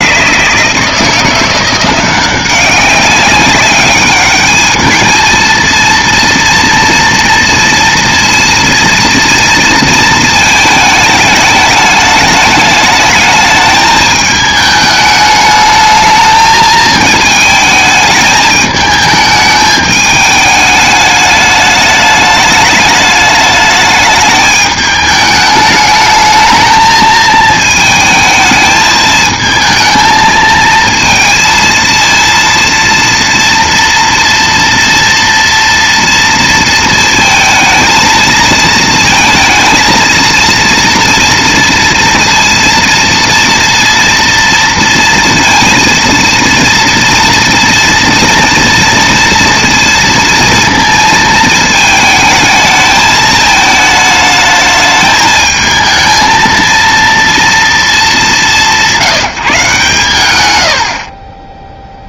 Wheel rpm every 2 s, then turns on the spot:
160, 190, 210, 230, 230, 220, 210, 210, 220, 210, 210, 210, 210, 220, 220, 220, 230, 230, 230, 230, 230, 230, 230, 230, 230, 230, 220, 220, 230, 160, 140.
none